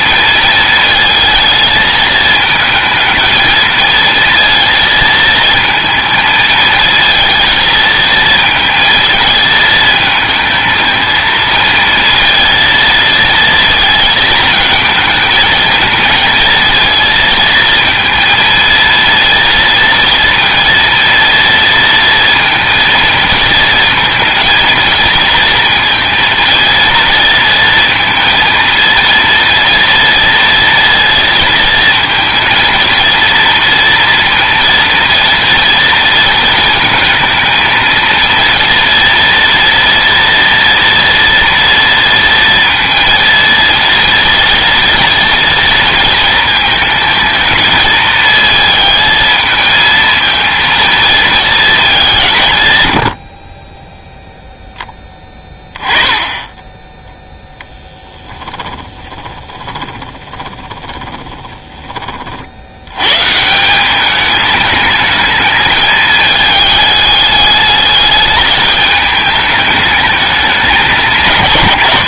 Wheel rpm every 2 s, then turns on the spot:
220, 220, 220, 220, 230, 220, 230, 220, 230, 230, 230, 230, 230, 230, 230, 230, 230, 230, 230, 230, 240, 230, 230, 220, 220, 230, 110, 0, 10, 20, 20, 90, 210, 210, 210, 170.
58-62